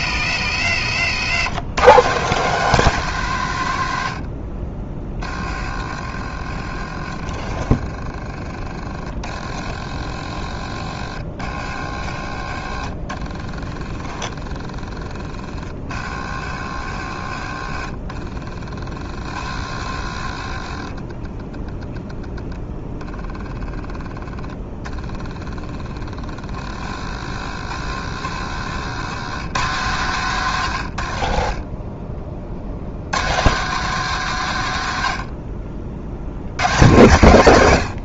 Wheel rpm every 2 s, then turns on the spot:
90, 160, 40, 50, 30, 50, 50, 30, 60, 40, 30, 10, 10, 40, 100, 110, 70, 100, 120.
0-2 4-6 30-32